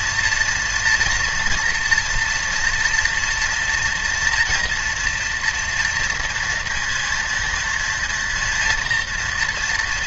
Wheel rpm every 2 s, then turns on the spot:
230, 240, 230, 230, 230.
none